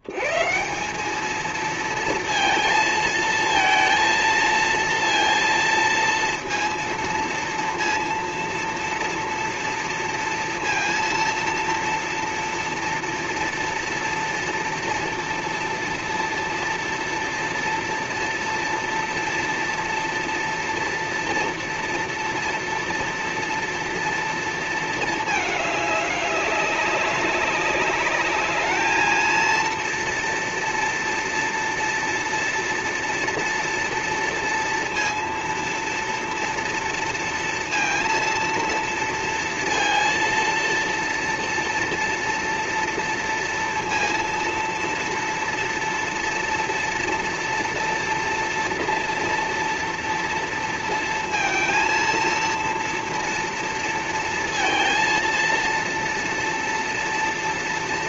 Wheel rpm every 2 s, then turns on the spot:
90, 230, 230, 230, 230, 230, 230, 230, 230, 230, 230, 230, 230, 200, 210, 230, 240, 230, 230, 230, 230, 240, 230, 230, 230, 230, 230, 230, 230.
none